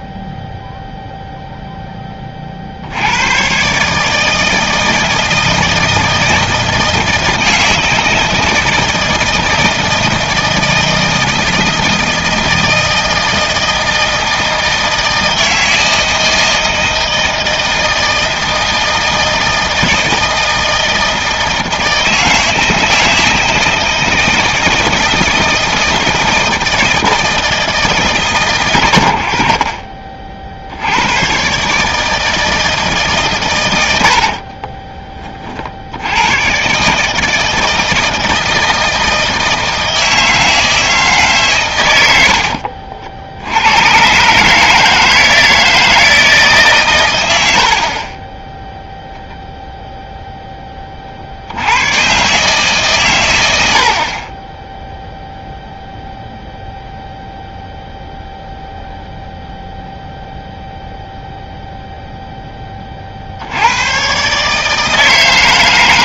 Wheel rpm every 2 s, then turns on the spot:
0, 60, 160, 160, 160, 160, 160, 160, 160, 160, 160, 160, 160, 160, 100, 80, 150, 30, 130, 160, 160, 60, 150, 140, 10, 20, 140, 10, 0, 0, 0, 20, 150.
34-36 42-44